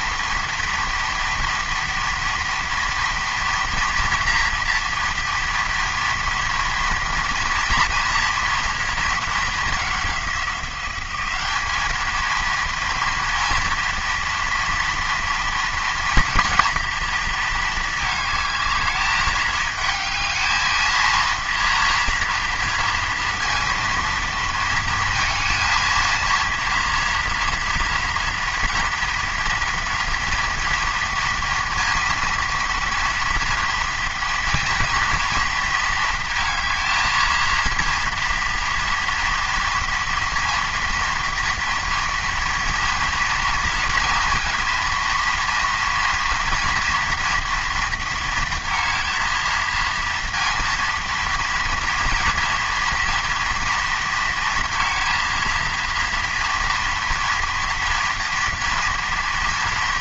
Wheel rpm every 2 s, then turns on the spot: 230, 230, 230, 230, 230, 190, 230, 230, 230, 210, 220, 230, 230, 230, 240, 230, 230, 230, 220, 230, 230, 230, 230, 230, 230, 230, 230, 230, 240, 230.
none